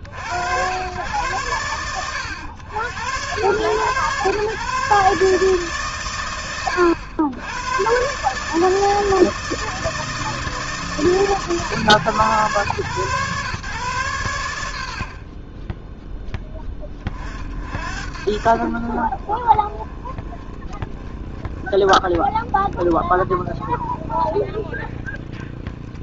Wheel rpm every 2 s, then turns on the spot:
100, 90, 120, 80, 140, 160, 120, 130, 20, 50, 20, 20, 20.
none